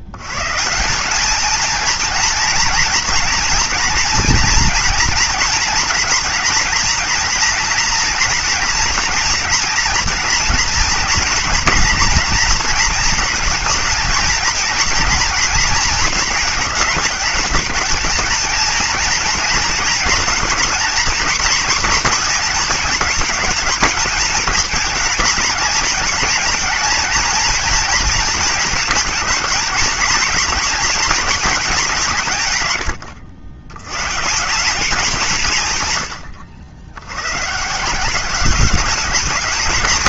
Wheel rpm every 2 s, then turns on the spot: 140, 230, 240, 230, 240, 230, 240, 230, 230, 220, 230, 240, 230, 230, 220, 230, 160, 180, 90, 190.
none